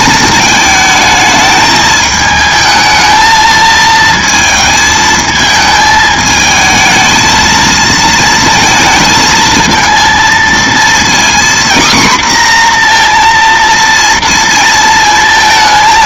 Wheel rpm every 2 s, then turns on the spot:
220, 220, 220, 220, 230, 230, 250, 230.
none